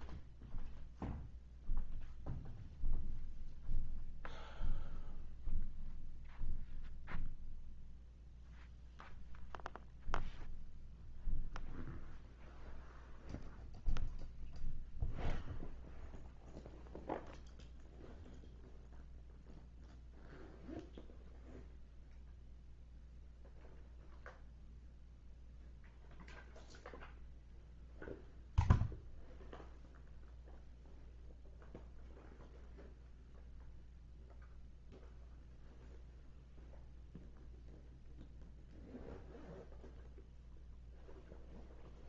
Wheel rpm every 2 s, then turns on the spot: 0, 0, 0, 0, 0, 0, 0, 0, 0, 0, 0, 0, 0, 0, 0, 0, 0, 0, 0, 0, 0.
none